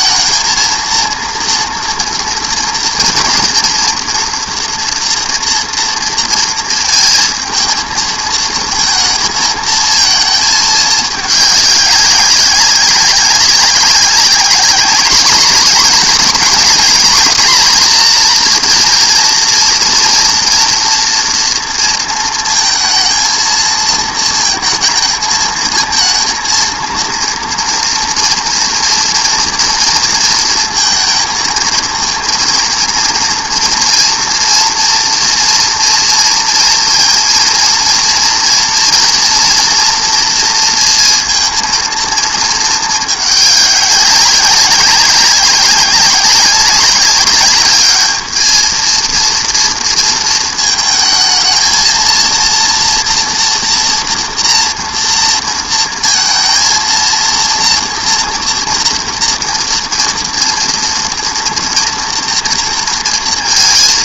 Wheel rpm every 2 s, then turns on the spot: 230, 230, 230, 230, 220, 220, 200, 200, 220, 230, 230, 230, 220, 230, 230, 230, 230, 240, 230, 230, 230, 220, 190, 200, 220, 220, 230, 230, 230, 230, 240, 230.
none